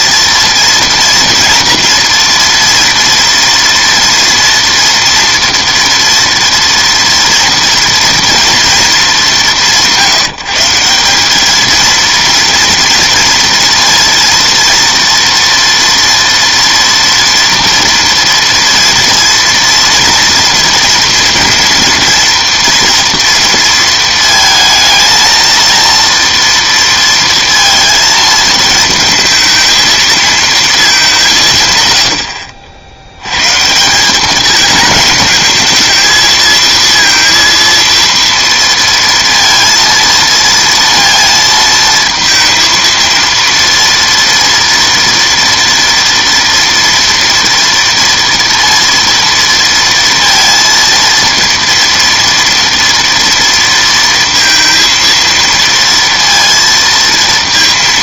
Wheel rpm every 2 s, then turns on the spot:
230, 230, 230, 230, 230, 160, 230, 230, 230, 230, 230, 230, 220, 230, 220, 220, 70, 220, 230, 230, 230, 230, 230, 230, 230, 230, 230, 230, 230.
none